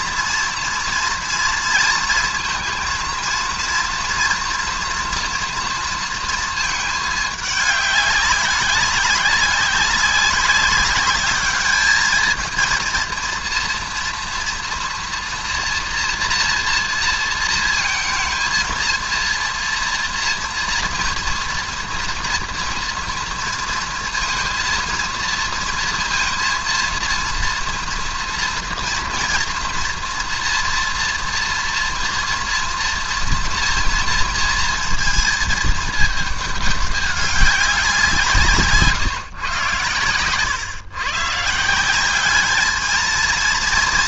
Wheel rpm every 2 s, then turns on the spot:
230, 230, 230, 220, 190, 190, 220, 230, 230, 230, 230, 230, 230, 230, 230, 230, 230, 230, 210, 150, 120, 210.
none